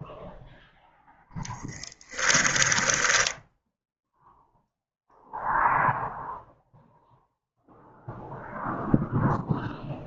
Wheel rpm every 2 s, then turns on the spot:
0, 10, 0, 0, 0.
2-4